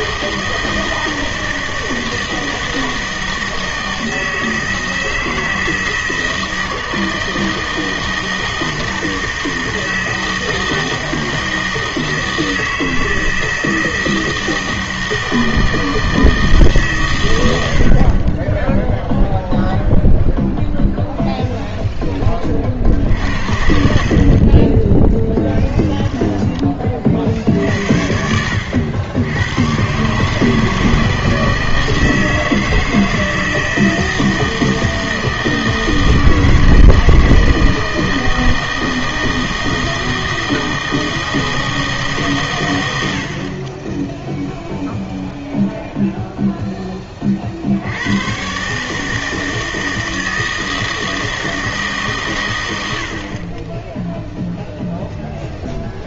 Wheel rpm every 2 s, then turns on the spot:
160, 160, 160, 160, 160, 160, 160, 160, 160, 20, 0, 40, 20, 10, 80, 160, 160, 160, 160, 160, 160, 120, 0, 0, 140, 160, 100, 0.
none